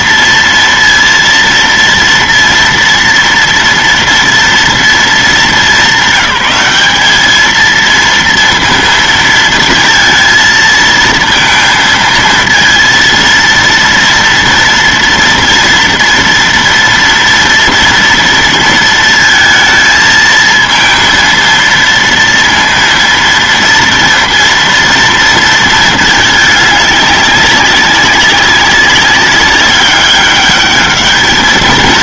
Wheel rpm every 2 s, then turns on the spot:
230, 230, 220, 200, 230, 230, 230, 240, 230, 230, 230, 230, 230, 210, 200, 210.
none